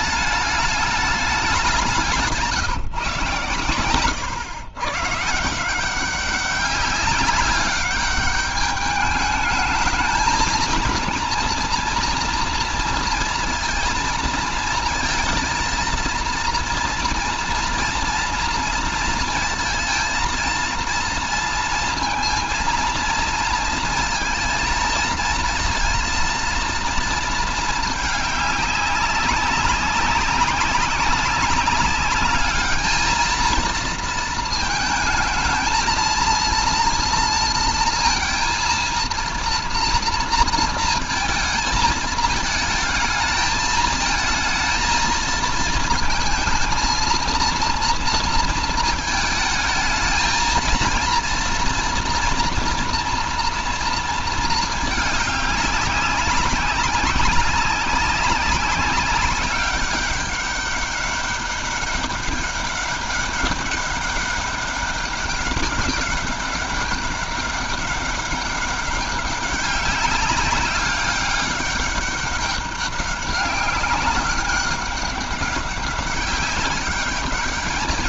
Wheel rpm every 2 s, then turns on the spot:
200, 130, 150, 200, 210, 230, 230, 230, 230, 230, 230, 230, 230, 230, 190, 200, 220, 220, 230, 230, 230, 220, 220, 230, 220, 230, 230, 210, 200, 200, 200, 200, 190, 200, 190, 200, 200, 200, 210.
none